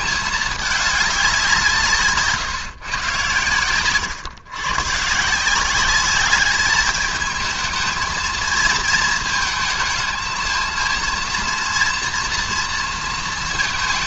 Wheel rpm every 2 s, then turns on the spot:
210, 140, 120, 200, 230, 220, 230.
none